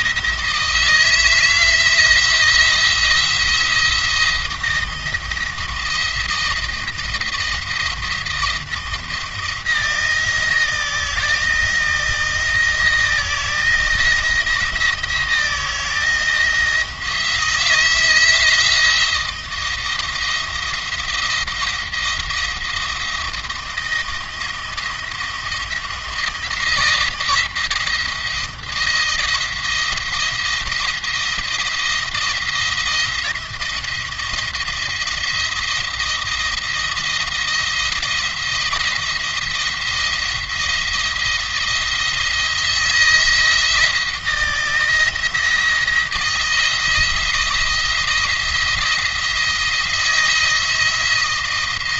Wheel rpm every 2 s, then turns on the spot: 160, 170, 170, 170, 170, 170, 170, 170, 160, 160, 170, 170, 170, 170, 170, 170, 170, 170, 170, 170, 170, 160, 160, 160, 170, 160.
none